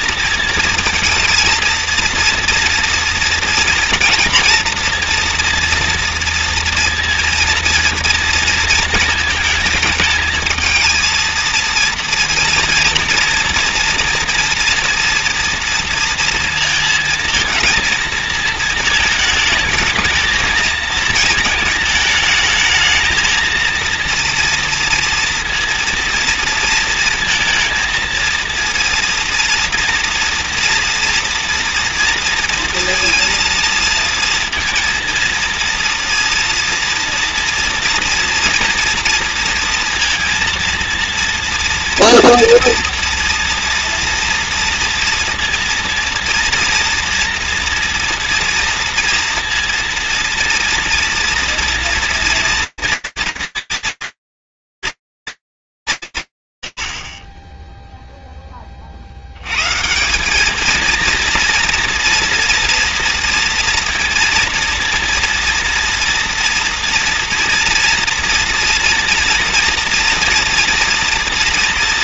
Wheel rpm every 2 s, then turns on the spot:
230, 230, 230, 230, 220, 220, 230, 230, 230, 220, 220, 220, 230, 230, 230, 230, 230, 230, 230, 230, 230, 240, 230, 230, 230, 230, 230, 230, 120, 40, 220, 230, 230, 230, 230, 230.
none